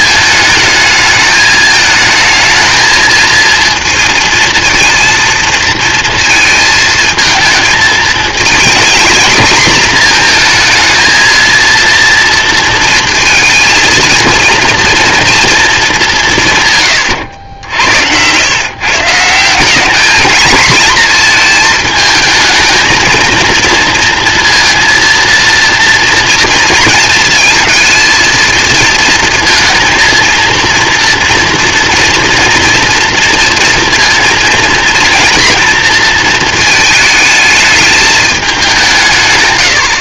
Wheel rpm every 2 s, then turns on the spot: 220, 220, 230, 230, 230, 230, 230, 230, 130, 140, 230, 220, 230, 230, 220, 230, 240, 230, 220, 200.
none